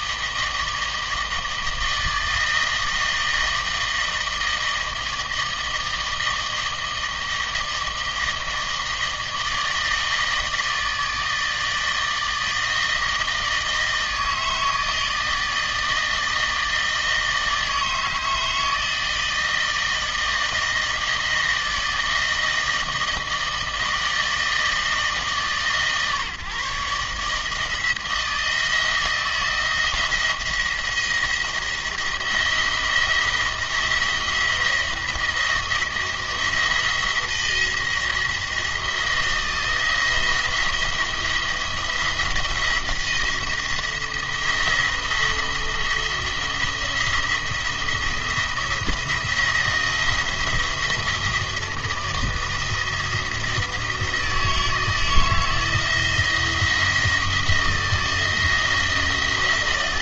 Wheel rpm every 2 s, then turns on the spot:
160, 160, 160, 160, 160, 160, 160, 160, 160, 160, 160, 160, 160, 150, 170, 170, 170, 170, 170, 170, 170, 170, 170, 170, 170, 160, 170, 160, 170, 170.
none